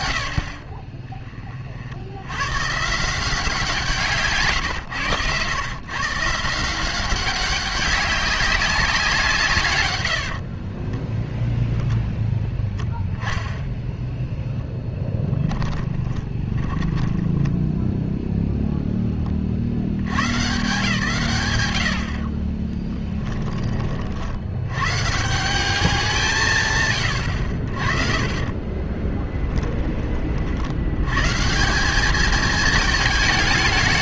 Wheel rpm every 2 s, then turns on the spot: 30, 150, 120, 180, 190, 10, 0, 10, 20, 0, 140, 10, 80, 140, 20, 110, 220.
10-12 16-18 22-24 26-30